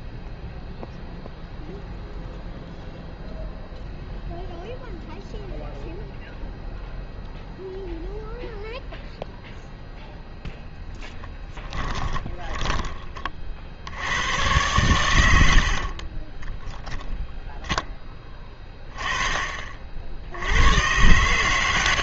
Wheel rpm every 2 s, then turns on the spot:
0, 0, 0, 0, 0, 0, 20, 110, 0, 20, 100.
12-14